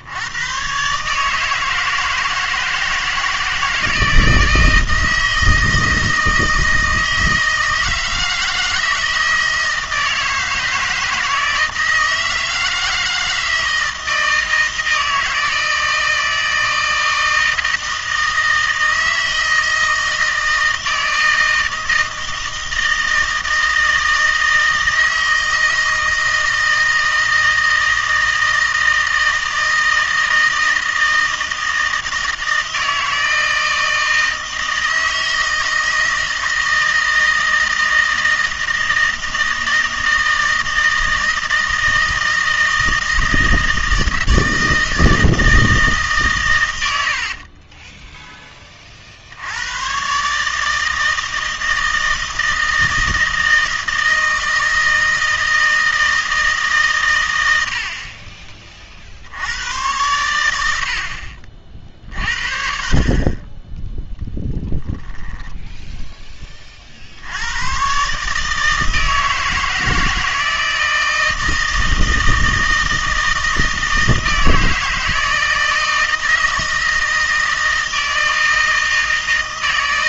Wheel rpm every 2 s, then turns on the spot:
130, 160, 160, 160, 160, 160, 160, 160, 160, 160, 160, 160, 160, 160, 160, 160, 160, 160, 160, 160, 160, 160, 160, 100, 20, 160, 160, 160, 150, 40, 80, 40, 10, 40, 160, 160, 160, 160, 160, 160.
64-66